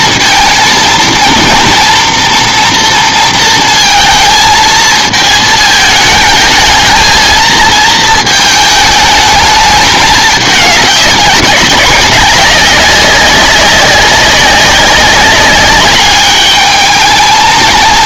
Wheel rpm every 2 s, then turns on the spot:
230, 230, 220, 220, 220, 200, 190, 190, 210.
none